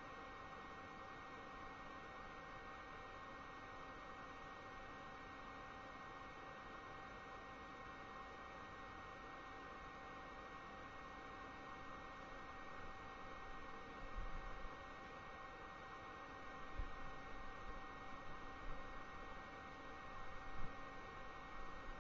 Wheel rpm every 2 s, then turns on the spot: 0, 0, 0, 0, 0, 0, 0, 0, 0, 0, 0.
none